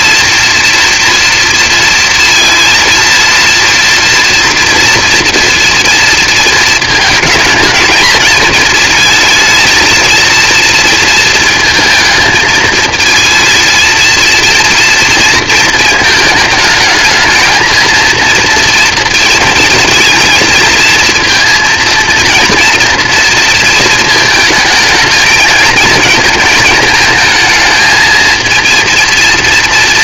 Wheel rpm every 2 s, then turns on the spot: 230, 240, 230, 230, 220, 230, 230, 230, 220, 230, 230, 230, 220, 220, 230.
none